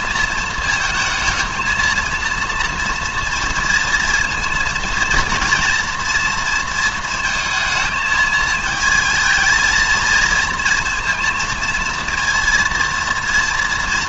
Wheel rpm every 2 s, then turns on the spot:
220, 230, 230, 230, 220, 230, 230.
none